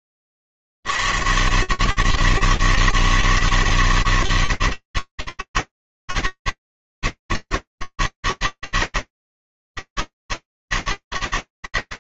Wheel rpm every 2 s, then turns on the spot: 70, 160, 160, 140, 150, 160.
none